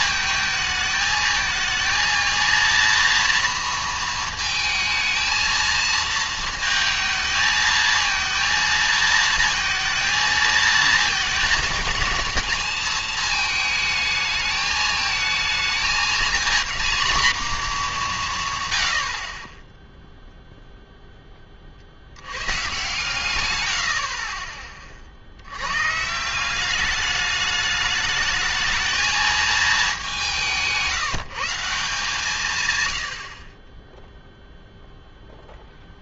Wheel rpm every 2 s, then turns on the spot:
220, 230, 220, 220, 230, 220, 220, 220, 230, 120, 0, 130, 30, 190, 220, 180, 130, 0.
none